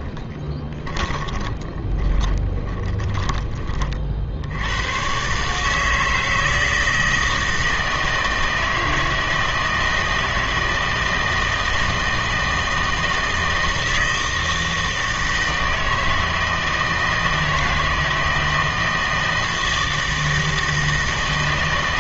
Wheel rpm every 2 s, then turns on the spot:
20, 20, 140, 160, 160, 160, 160, 160, 160, 160, 160.
0-2